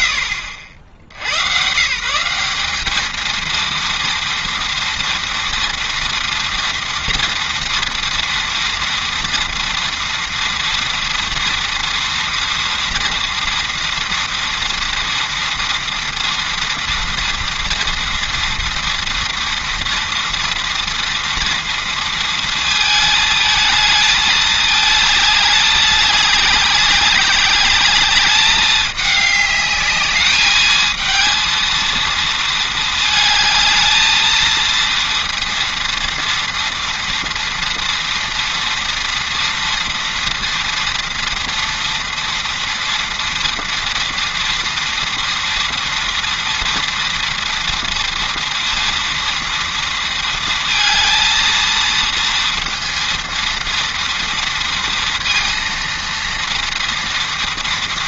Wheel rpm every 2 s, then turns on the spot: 80, 220, 230, 230, 230, 230, 230, 230, 230, 230, 230, 220, 210, 200, 210, 220, 220, 230, 230, 230, 230, 230, 230, 230, 230, 230, 230, 230, 230.
none